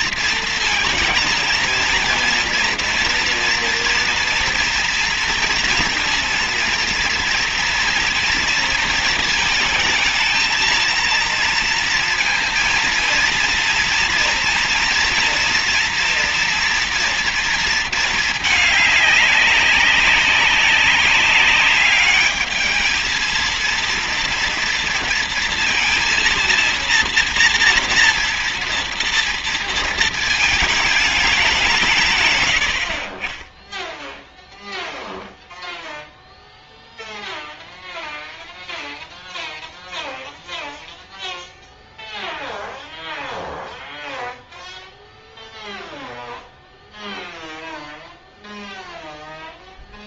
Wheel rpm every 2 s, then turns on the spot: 230, 230, 230, 230, 230, 220, 230, 240, 230, 210, 200, 220, 230, 230, 230, 220, 100, 0, 0, 0, 0, 0, 0, 0, 0.
none